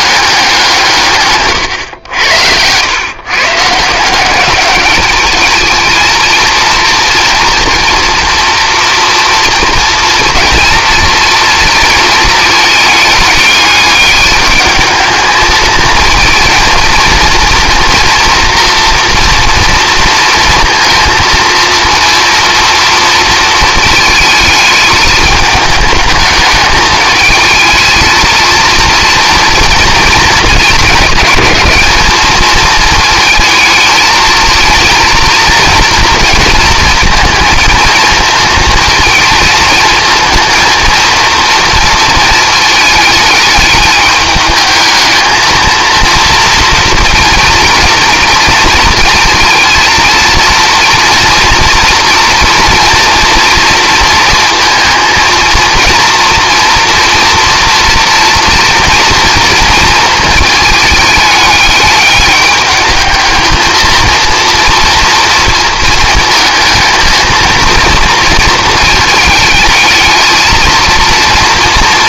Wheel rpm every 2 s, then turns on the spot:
180, 100, 200, 230, 230, 230, 210, 210, 230, 240, 230, 230, 220, 210, 230, 210, 220, 230, 230, 220, 230, 220, 220, 230, 230, 230, 230, 230, 240, 230, 220, 210, 230, 220, 220, 230.
none